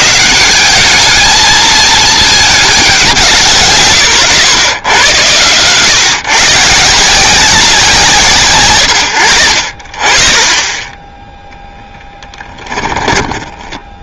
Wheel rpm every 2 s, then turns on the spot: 70, 220, 130, 150, 150, 40, 10.
12-14